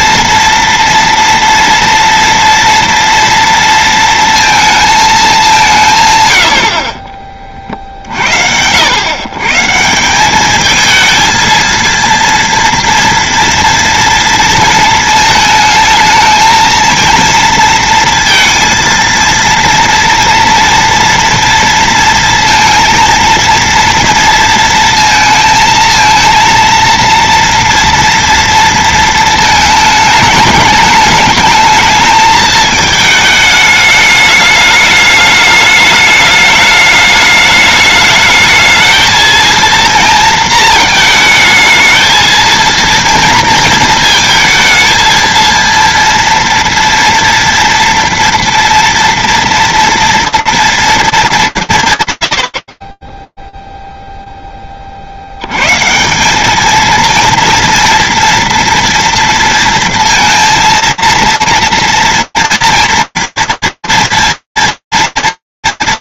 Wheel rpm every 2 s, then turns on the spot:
230, 230, 220, 50, 100, 220, 230, 220, 230, 230, 230, 230, 230, 230, 220, 210, 220, 210, 210, 220, 220, 230, 230, 240, 230, 230, 20, 20, 210, 230, 230, 230, 230.
none